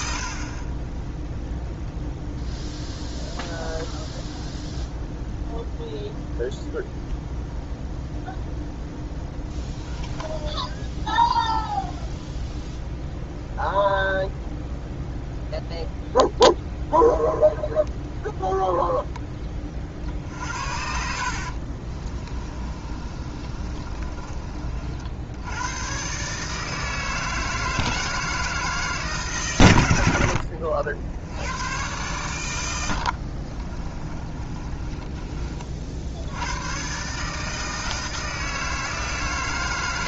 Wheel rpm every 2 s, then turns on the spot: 20, 0, 0, 0, 0, 10, 10, 0, 0, 0, 70, 30, 50, 160, 150, 70, 90, 20, 120, 160.
20-24 32-36